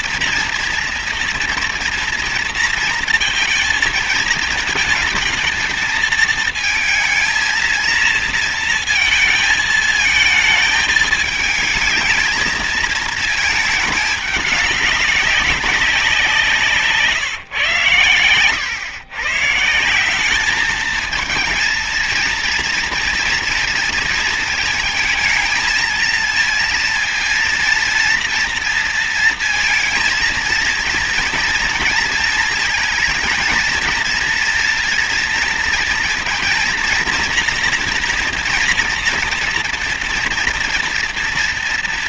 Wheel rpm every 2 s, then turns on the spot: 230, 230, 220, 220, 230, 220, 220, 210, 170, 100, 190, 230, 220, 230, 230, 230, 230, 230, 230, 240, 230.
none